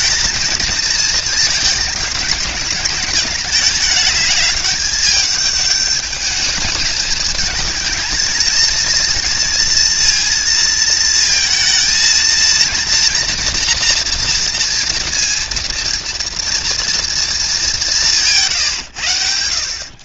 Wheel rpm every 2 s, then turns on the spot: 230, 210, 210, 220, 230, 230, 230, 230, 230, 140.
none